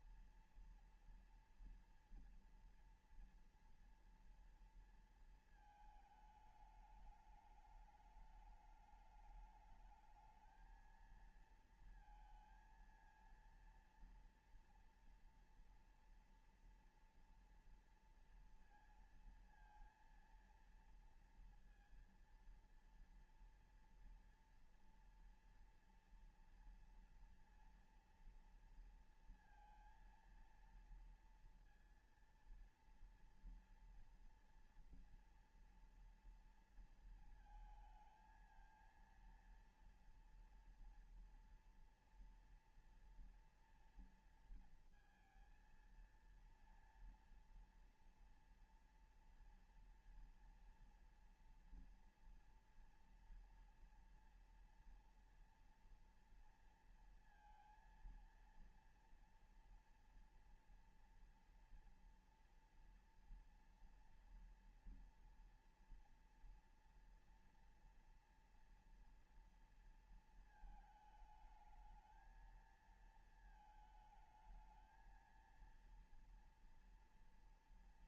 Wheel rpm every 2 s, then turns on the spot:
230, 240, 230, 220, 210, 220, 230, 230, 230, 230, 230, 230, 230, 230, 230, 230, 230, 240, 230, 220, 230, 240, 240, 230, 230, 230, 230, 240, 230, 230, 230, 240, 240, 230, 230, 230, 220, 220, 230.
none